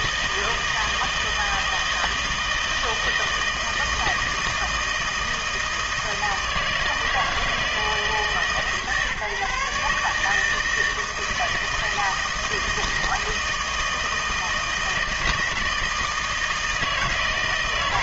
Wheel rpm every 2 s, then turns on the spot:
160, 160, 160, 160, 150, 160, 160, 160, 160.
none